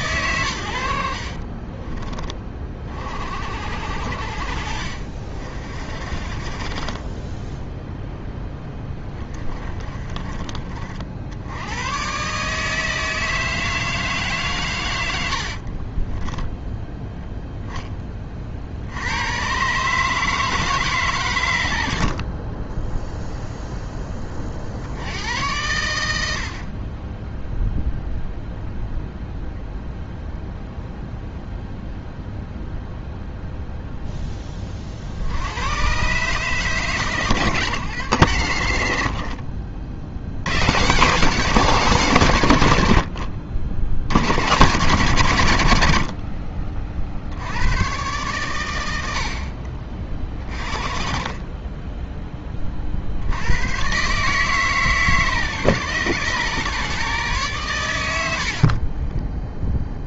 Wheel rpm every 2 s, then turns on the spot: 80, 40, 50, 30, 10, 40, 150, 110, 10, 70, 150, 10, 60, 40, 0, 0, 0, 40, 130, 60, 150, 90, 110, 40, 100, 30, 40, 140, 140, 50.
6-10 58-60